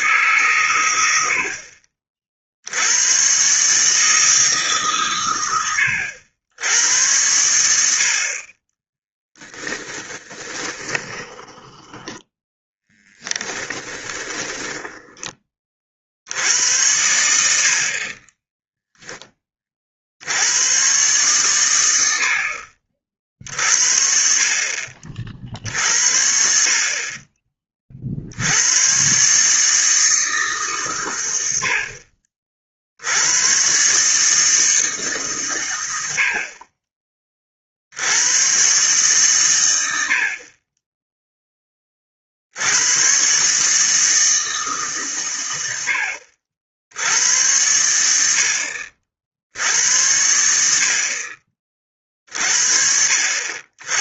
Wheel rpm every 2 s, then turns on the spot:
130, 60, 150, 90, 40, 20, 10, 20, 80, 10, 90, 60, 50, 60, 80, 150, 50, 160, 40, 120, 40, 70, 160, 60, 70, 70, 50.
8-16 18-20